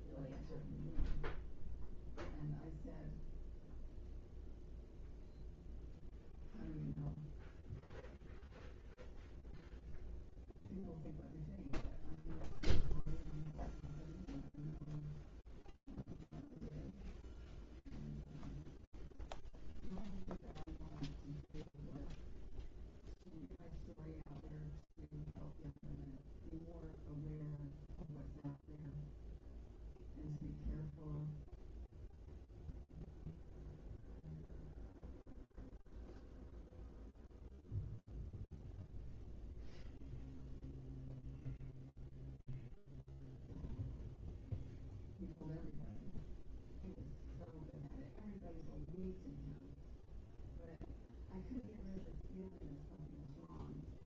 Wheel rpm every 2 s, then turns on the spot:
0, 0, 0, 0, 0, 0, 0, 0, 0, 0, 0, 0, 0, 0, 0, 0, 0, 0, 0, 0, 0, 0, 0, 0, 0, 0, 0.
none